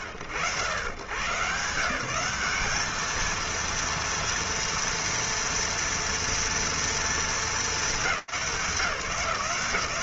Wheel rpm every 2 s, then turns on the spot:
110, 220, 230, 230, 170.
none